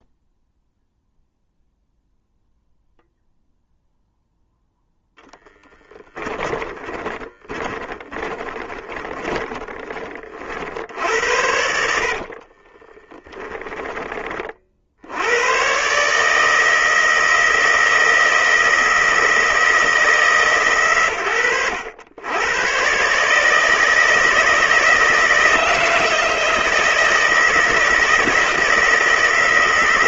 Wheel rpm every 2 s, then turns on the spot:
0, 0, 0, 20, 20, 70, 20, 70, 160, 160, 120, 130, 160, 160, 160.
6-10 12-14